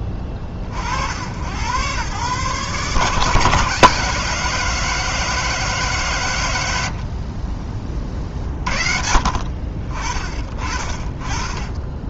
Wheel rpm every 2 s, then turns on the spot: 40, 140, 160, 80, 50, 30.
none